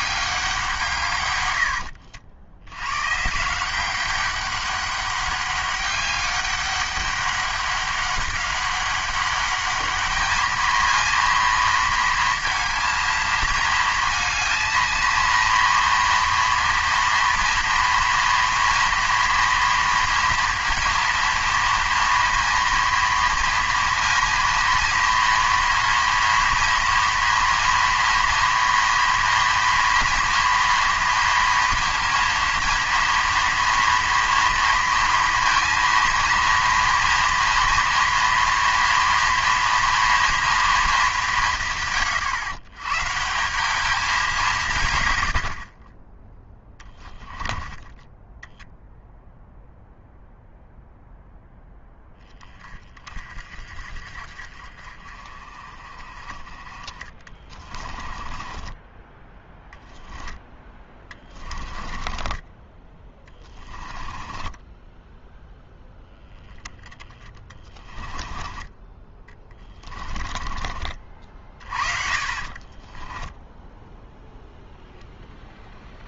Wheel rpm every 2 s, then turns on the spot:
170, 90, 200, 200, 190, 220, 230, 230, 230, 230, 230, 230, 230, 240, 230, 230, 230, 230, 230, 230, 230, 120, 150, 10, 0, 0, 30, 40, 40, 20, 20, 20, 10, 20, 10, 40, 30, 0.
46-48 58-62 64-66 72-74